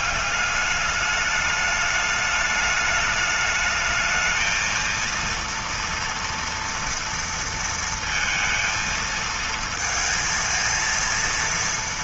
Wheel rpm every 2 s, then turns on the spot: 200, 210, 230, 230, 230, 230.
none